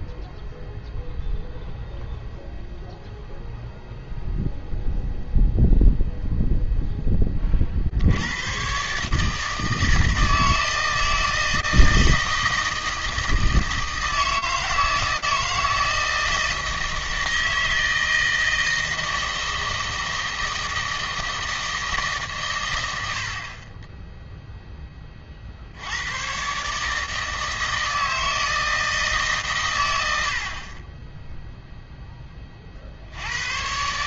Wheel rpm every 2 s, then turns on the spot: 0, 0, 0, 0, 130, 160, 160, 160, 160, 160, 160, 110, 10, 140, 160, 40, 50.
none